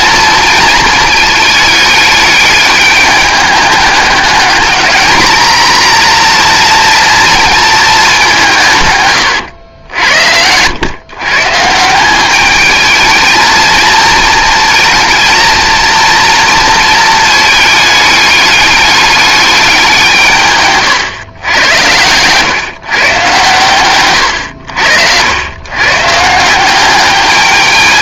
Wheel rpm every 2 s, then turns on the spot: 230, 210, 210, 240, 160, 100, 210, 220, 230, 210, 130, 140, 90, 180.
20-22